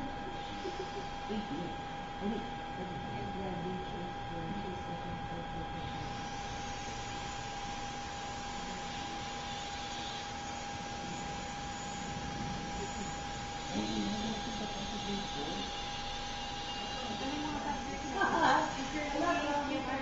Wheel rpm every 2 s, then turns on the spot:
0, 0, 0, 0, 0, 0, 0, 0, 0, 0.
none